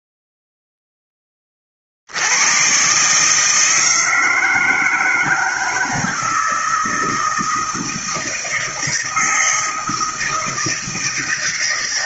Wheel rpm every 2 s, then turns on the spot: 0, 130, 160, 160, 160, 160.
none